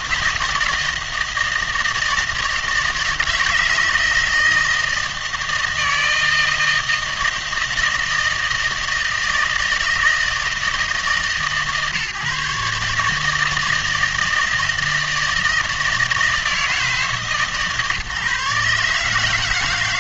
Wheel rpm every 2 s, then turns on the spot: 160, 160, 160, 160, 160, 150, 150, 160, 160, 140.
none